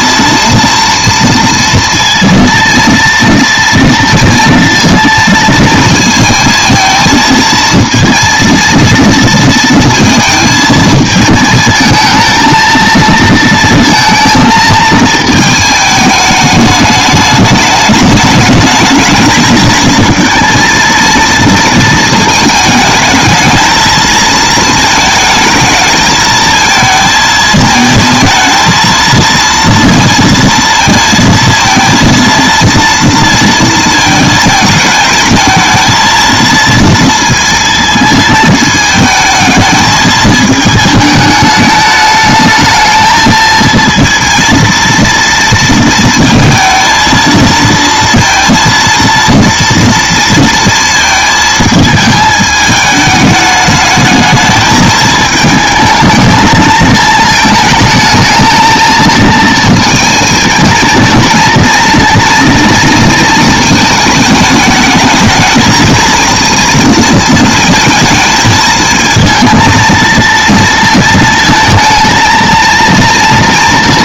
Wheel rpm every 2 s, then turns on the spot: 230, 230, 230, 220, 230, 220, 230, 220, 210, 220, 230, 220, 220, 220, 230, 230, 230, 220, 230, 220, 220, 220, 230, 230, 230, 230, 210, 220, 220, 220, 220, 230, 220, 230, 220, 230, 230.
none